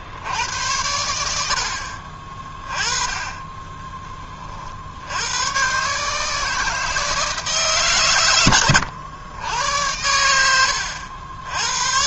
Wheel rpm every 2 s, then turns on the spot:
30, 50, 160, 100, 80, 140.
6-10